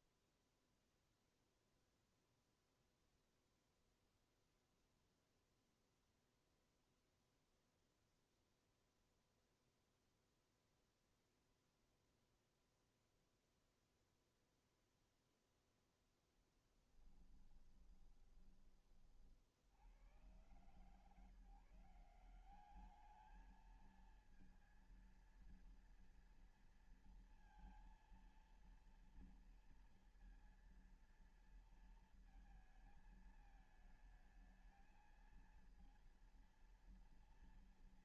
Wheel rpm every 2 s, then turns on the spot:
0, 0, 0, 0, 0, 0, 0, 0, 10, 30, 120, 200, 230, 230, 230, 230, 220, 220, 230.
16-18